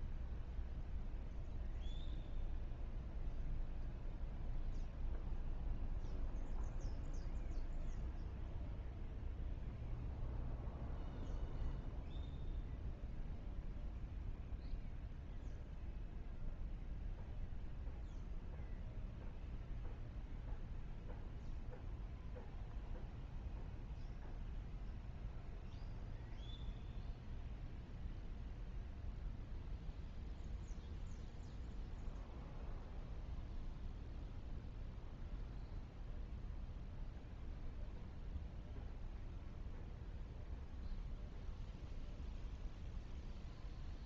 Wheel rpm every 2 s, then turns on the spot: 0, 0, 0, 0, 0, 0, 0, 0, 0, 0, 0, 0, 0, 0, 0, 0, 0, 0, 0, 0, 0, 0.
none